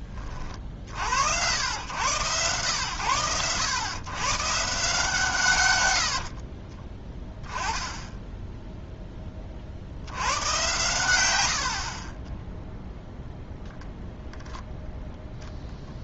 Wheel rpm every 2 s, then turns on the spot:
50, 110, 140, 30, 10, 110, 10, 0.
6-8 12-14